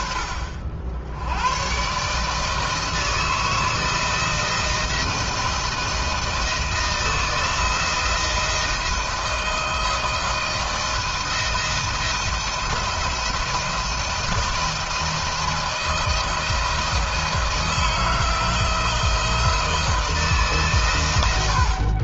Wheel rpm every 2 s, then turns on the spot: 50, 160, 160, 160, 160, 170, 170, 160, 170, 160, 120.
none